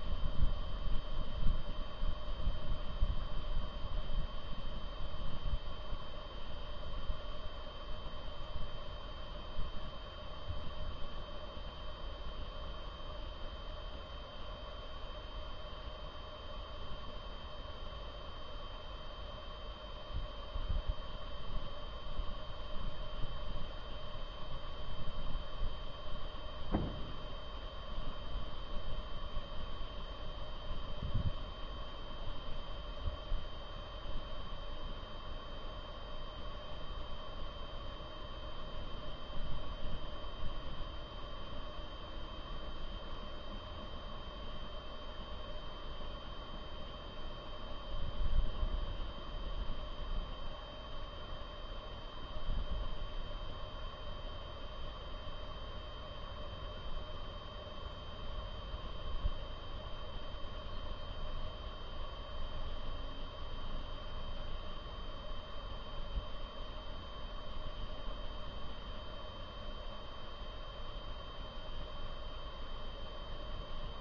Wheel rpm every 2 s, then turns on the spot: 0, 0, 0, 0, 0, 0, 0, 0, 0, 0, 0, 0, 0, 0, 0, 0, 0, 0, 0, 0, 0, 0, 0, 0, 0, 0, 0, 0, 0, 0, 0, 0, 0, 0, 0, 0, 0.
none